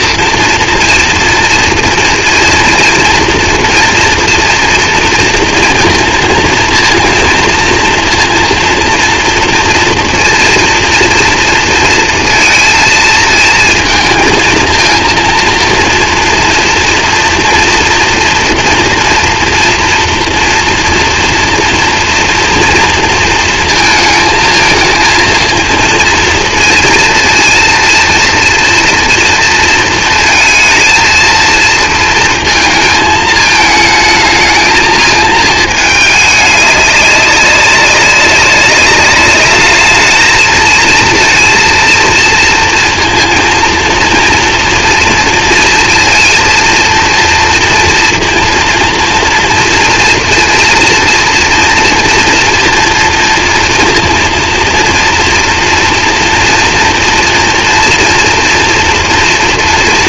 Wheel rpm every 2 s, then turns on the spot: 230, 230, 230, 230, 230, 230, 230, 230, 230, 240, 240, 240, 220, 230, 230, 220, 220, 220, 210, 200, 220, 230, 240, 230, 230, 230, 230, 230, 240, 240.
none